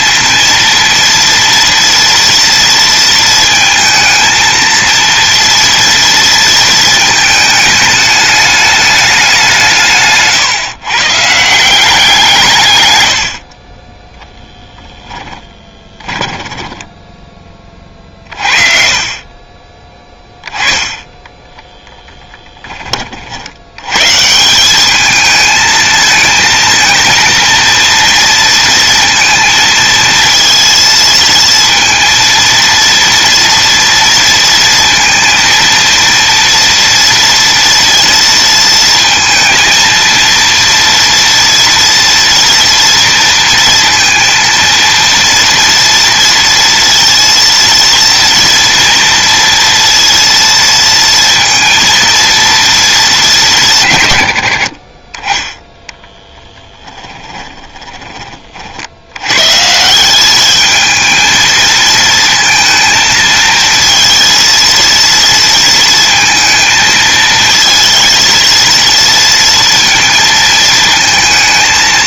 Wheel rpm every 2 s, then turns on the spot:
240, 230, 230, 220, 190, 150, 70, 10, 10, 30, 10, 50, 210, 230, 230, 230, 230, 230, 230, 230, 230, 230, 230, 230, 230, 230, 200, 30, 20, 90, 220, 230, 230, 230, 230, 230.
14-18 56-58